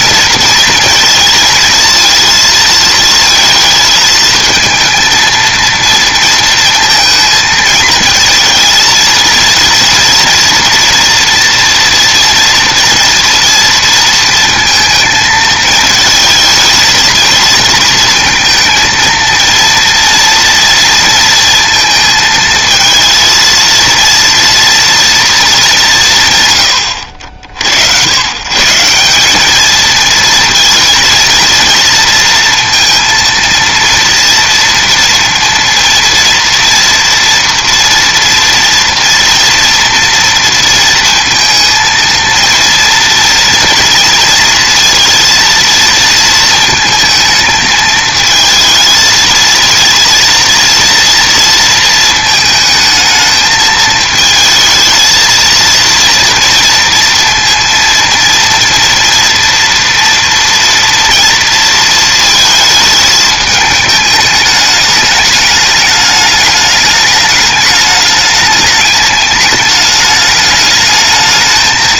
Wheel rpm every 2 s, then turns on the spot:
230, 220, 230, 220, 230, 240, 230, 220, 220, 230, 230, 230, 230, 90, 180, 230, 230, 230, 240, 230, 230, 230, 230, 230, 220, 230, 220, 220, 230, 230, 230, 220, 210, 210, 210, 210.
none